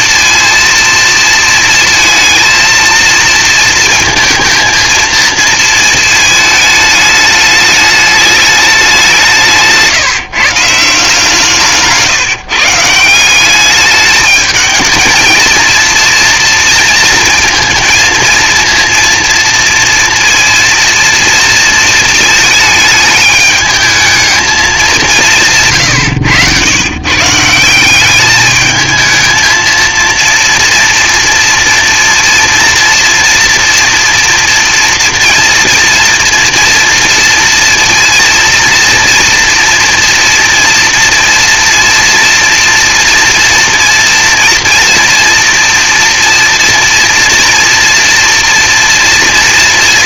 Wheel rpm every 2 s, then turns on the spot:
230, 230, 230, 210, 190, 160, 170, 220, 230, 230, 230, 220, 190, 130, 220, 230, 230, 230, 230, 230, 230, 230, 230, 230, 230.
none